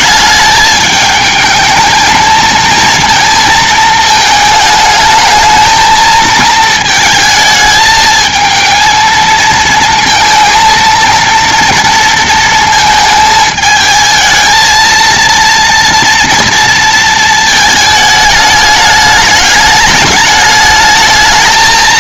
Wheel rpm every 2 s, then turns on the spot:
210, 220, 220, 230, 220, 230, 230, 220, 230, 220, 220.
none